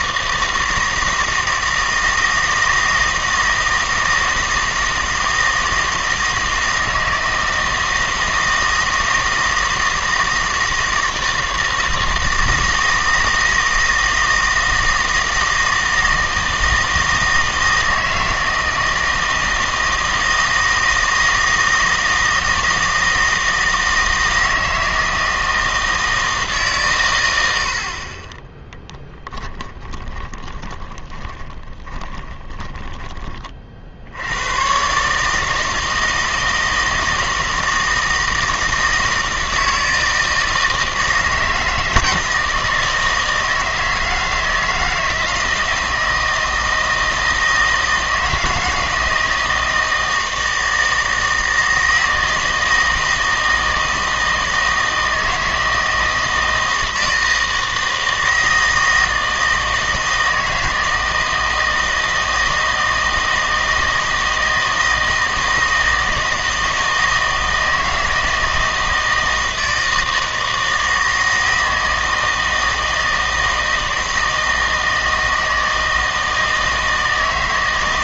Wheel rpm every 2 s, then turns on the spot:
160, 160, 160, 160, 160, 160, 160, 160, 160, 160, 160, 160, 160, 150, 20, 20, 20, 110, 160, 160, 160, 160, 160, 160, 160, 160, 160, 160, 160, 160, 160, 160, 160, 160, 160, 160, 160, 160, 160.
30-34